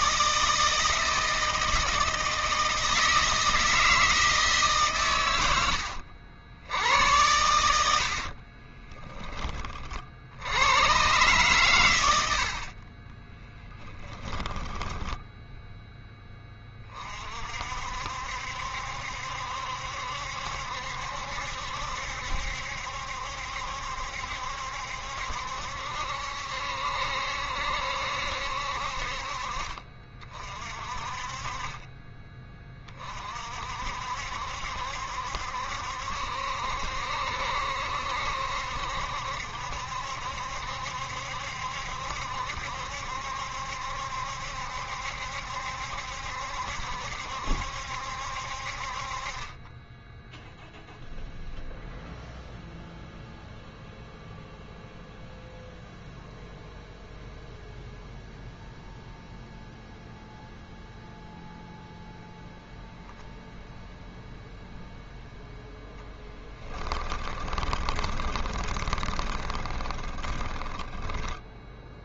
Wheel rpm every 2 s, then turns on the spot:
160, 160, 140, 80, 20, 100, 50, 20, 20, 70, 70, 70, 70, 70, 60, 40, 30, 70, 70, 70, 70, 70, 70, 70, 50, 0, 0, 0, 0, 0, 0, 0, 0, 10, 20, 10.
8-10 12-16 66-72